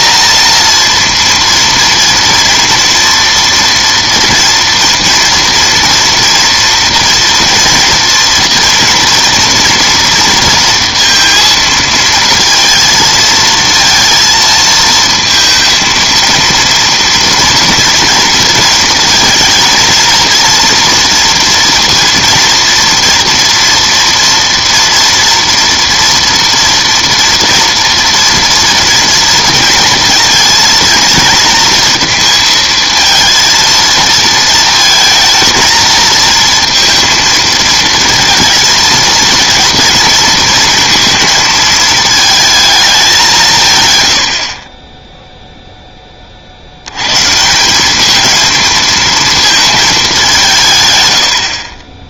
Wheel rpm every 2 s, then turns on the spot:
230, 230, 230, 230, 230, 230, 230, 230, 230, 230, 230, 230, 230, 230, 230, 230, 220, 230, 230, 230, 230, 220, 30, 70, 220, 150.
none